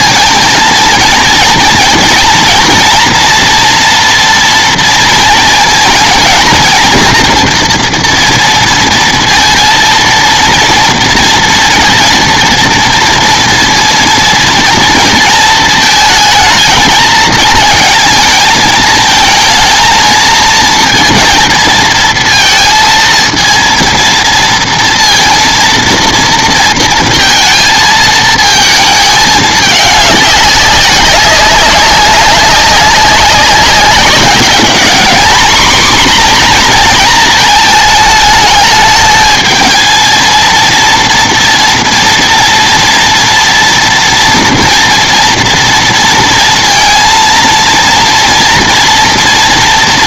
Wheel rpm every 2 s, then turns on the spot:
230, 240, 230, 230, 230, 230, 230, 230, 220, 220, 230, 230, 230, 230, 220, 200, 190, 210, 240, 220, 230, 240, 240, 230, 230.
none